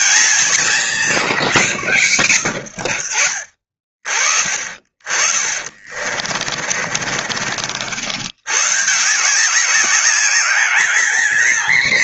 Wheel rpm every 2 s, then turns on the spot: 200, 90, 40, 40, 140, 210.
6-8